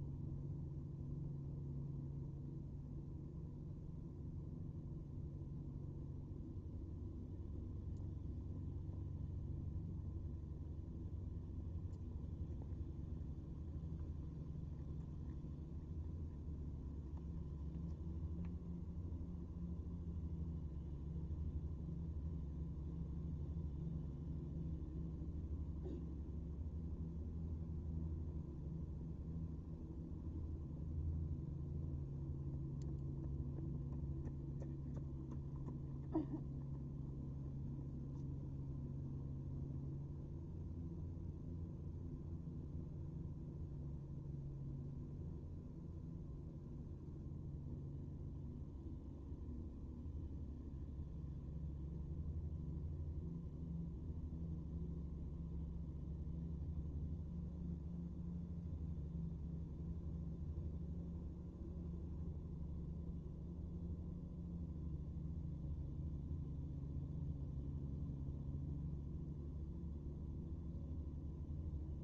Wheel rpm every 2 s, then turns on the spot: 0, 0, 0, 0, 0, 0, 0, 0, 0, 0, 0, 0, 0, 0, 0, 0, 0, 0, 0, 0, 0, 0, 0, 0, 0, 0, 0, 0, 0, 0, 0, 0, 0, 0, 0, 0.
none